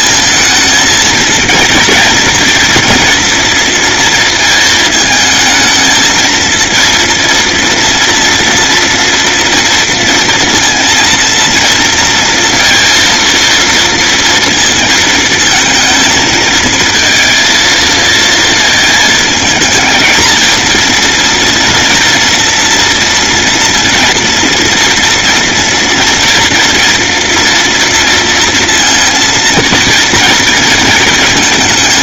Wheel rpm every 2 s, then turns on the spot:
230, 230, 230, 230, 230, 230, 230, 230, 230, 220, 230, 230, 230, 230, 230, 230.
none